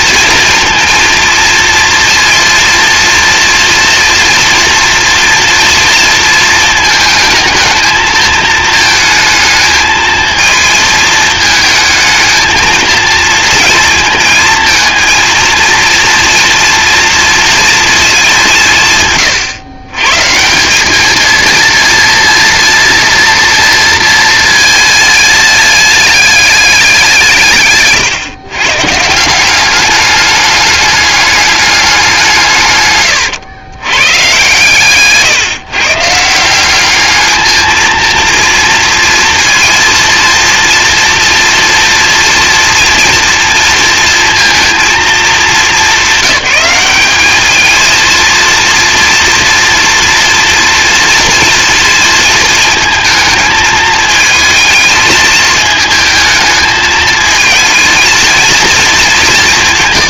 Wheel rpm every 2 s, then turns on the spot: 230, 230, 230, 230, 220, 220, 230, 230, 240, 170, 170, 230, 220, 210, 130, 200, 150, 140, 180, 230, 230, 230, 230, 210, 230, 230, 230, 220, 220, 230.
none